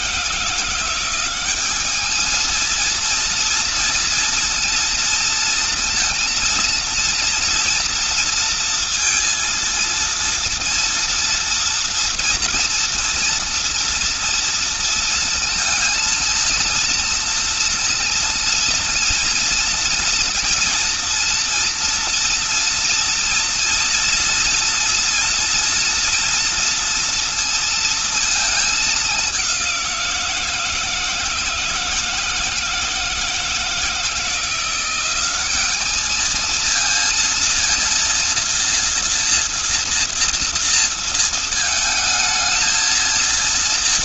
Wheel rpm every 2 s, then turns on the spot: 170, 220, 230, 230, 230, 230, 240, 230, 230, 230, 240, 230, 230, 230, 220, 170, 160, 170, 220, 230, 230, 220.
none